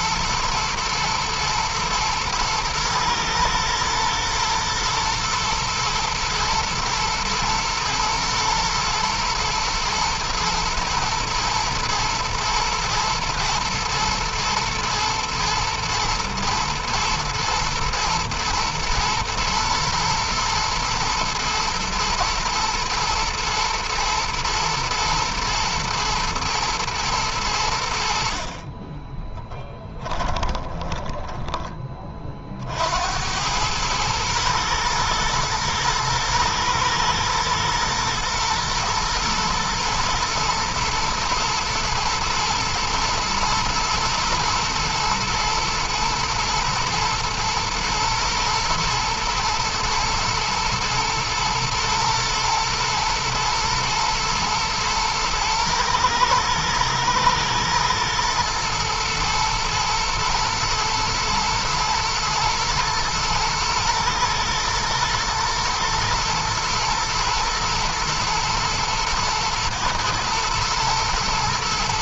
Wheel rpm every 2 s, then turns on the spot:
110, 120, 120, 110, 120, 120, 120, 110, 110, 120, 110, 110, 120, 110, 20, 20, 70, 120, 120, 120, 120, 120, 120, 120, 110, 110, 110, 110, 110, 110, 110, 110, 110, 110, 110, 110.
28-32